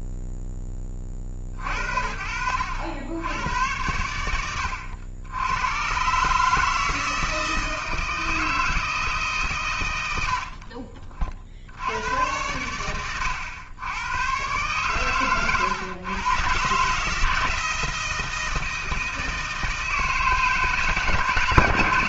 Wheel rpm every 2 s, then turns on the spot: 10, 70, 80, 150, 160, 60, 110, 120, 130, 160, 150.
10-12